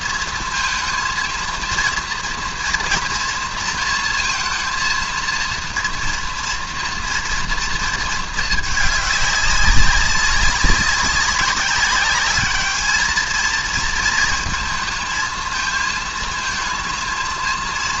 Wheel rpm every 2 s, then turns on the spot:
230, 230, 230, 230, 210, 190, 210, 220, 230.
none